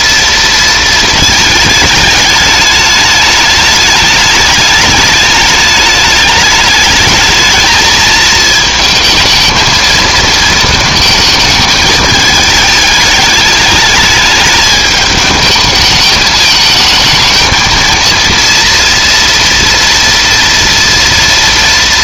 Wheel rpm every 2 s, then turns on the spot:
230, 210, 210, 210, 220, 230, 220, 220, 210, 230, 230.
none